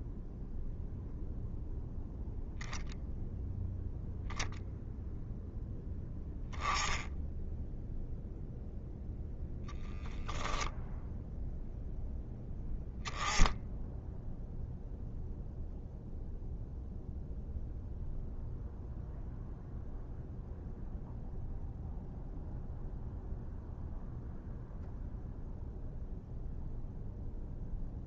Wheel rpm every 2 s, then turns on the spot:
0, 0, 0, 0, 0, 0, 10, 0, 0, 0, 0, 0, 0, 0.
none